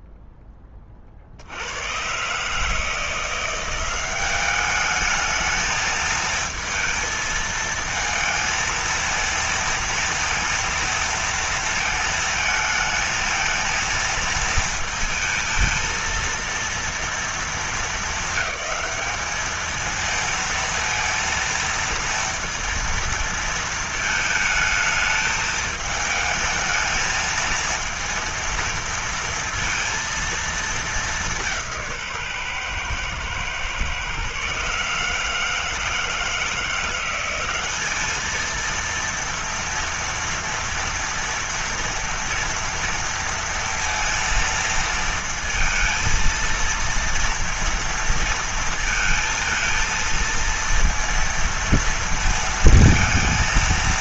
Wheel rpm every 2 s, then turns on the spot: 10, 130, 200, 220, 220, 230, 220, 230, 230, 200, 230, 230, 220, 220, 230, 230, 130, 140, 160, 220, 230, 230, 230, 230, 230, 230, 230.
none